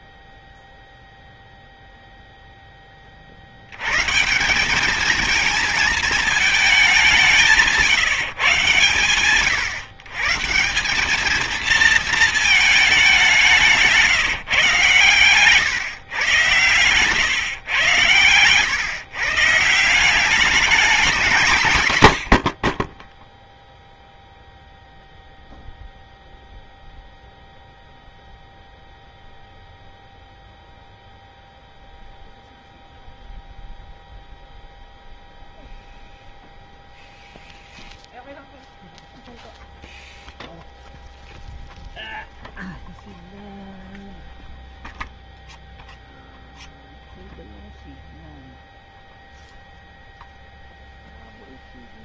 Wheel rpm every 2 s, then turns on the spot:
0, 0, 150, 210, 140, 150, 220, 140, 110, 110, 200, 80, 0, 0, 0, 0, 0, 0, 0, 0, 0, 0, 0, 0, 0, 0.
none